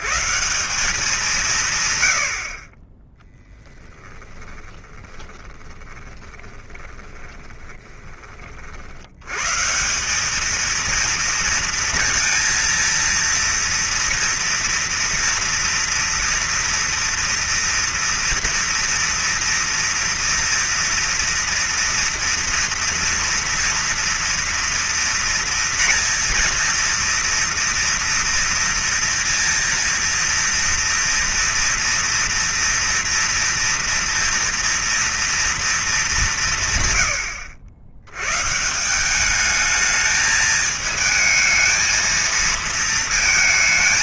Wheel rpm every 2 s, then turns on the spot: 180, 30, 20, 30, 80, 230, 230, 230, 230, 230, 230, 230, 230, 230, 230, 230, 230, 230, 130, 170, 220, 230.
4-8